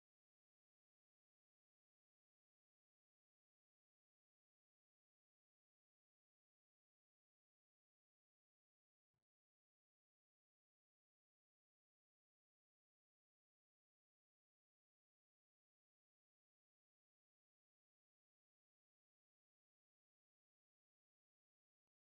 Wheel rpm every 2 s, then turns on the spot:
0, 0, 0, 0, 0, 0, 0, 0, 0, 0, 0.
none